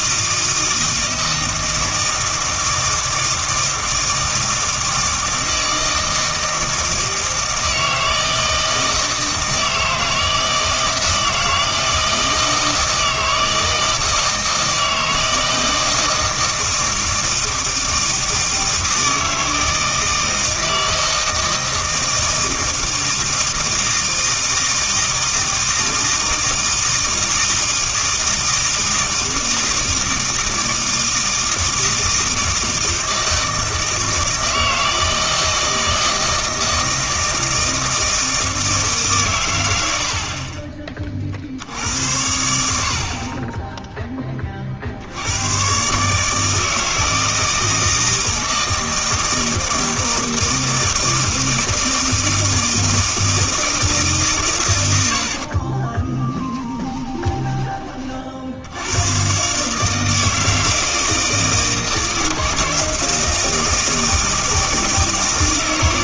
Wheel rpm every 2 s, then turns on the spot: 160, 160, 160, 160, 160, 160, 160, 160, 160, 160, 160, 160, 160, 160, 160, 160, 160, 160, 160, 160, 30, 60, 50, 160, 160, 160, 160, 100, 10, 90, 160, 160, 160.
56-58